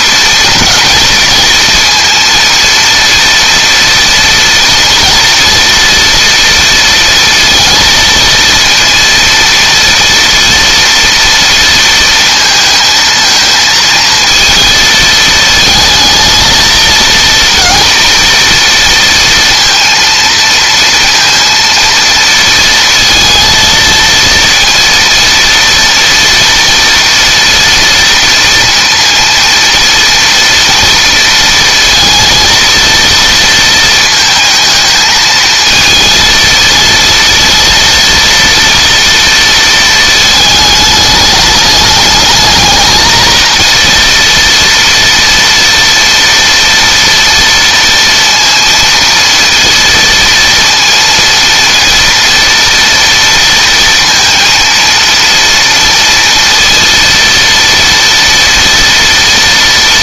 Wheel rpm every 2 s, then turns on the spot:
230, 230, 230, 230, 230, 230, 220, 230, 230, 230, 230, 230, 230, 240, 230, 230, 230, 220, 230, 230, 210, 220, 230, 230, 230, 230, 230, 230, 230, 230.
none